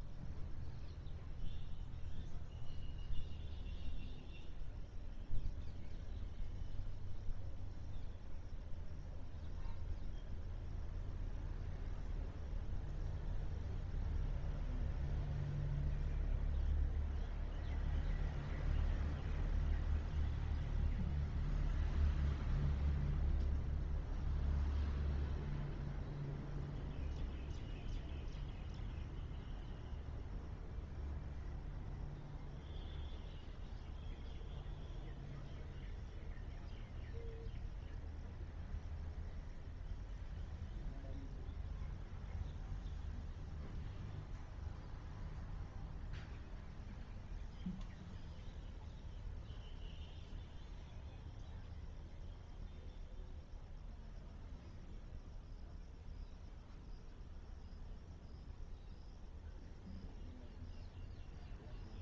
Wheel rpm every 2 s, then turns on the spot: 0, 0, 0, 0, 0, 0, 0, 0, 0, 0, 0, 0, 0, 0, 0, 0, 0, 0, 0, 0, 0, 0, 0, 0, 0, 0, 0, 0, 0, 0, 0.
none